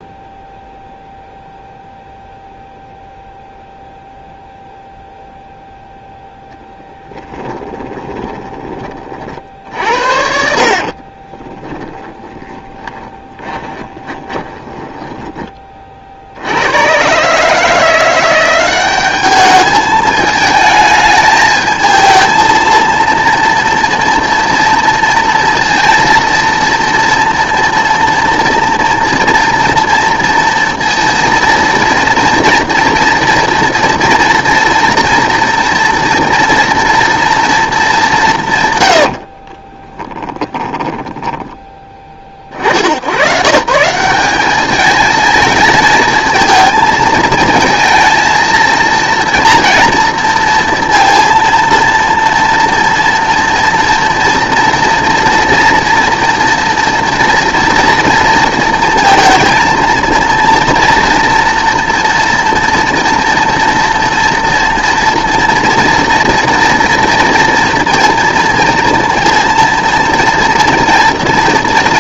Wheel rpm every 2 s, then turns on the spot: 0, 0, 0, 10, 30, 50, 20, 10, 100, 190, 220, 230, 230, 230, 230, 230, 230, 230, 240, 120, 10, 70, 210, 220, 230, 230, 230, 230, 230, 230, 230, 230, 230, 240, 230, 230.
6-8 10-16 38-42